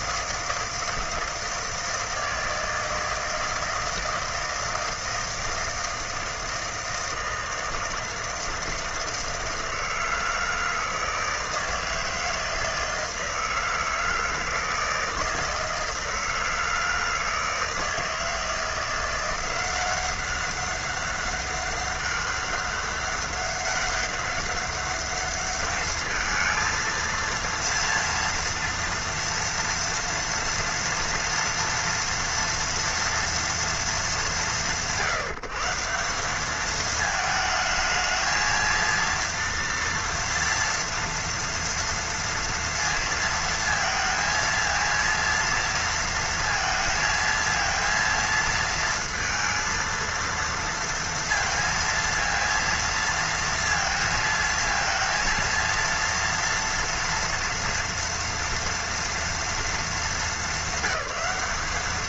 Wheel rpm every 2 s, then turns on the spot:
160, 160, 160, 160, 160, 160, 160, 160, 160, 160, 190, 200, 200, 220, 230, 230, 240, 160, 210, 220, 230, 230, 230, 230, 230, 230, 230, 230, 230, 230, 210.
none